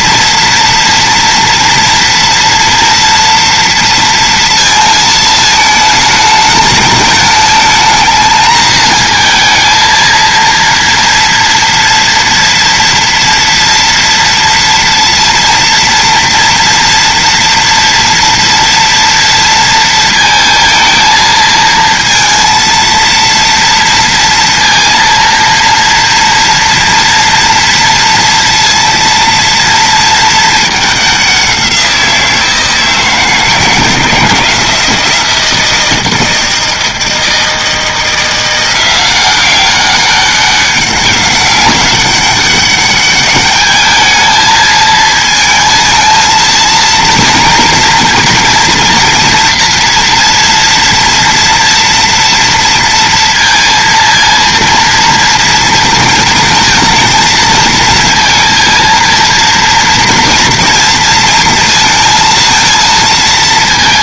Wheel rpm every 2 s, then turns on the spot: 230, 230, 230, 210, 220, 230, 230, 230, 230, 230, 220, 230, 230, 230, 230, 210, 170, 170, 160, 180, 200, 200, 220, 230, 230, 230, 230, 230, 230, 230, 230, 230.
none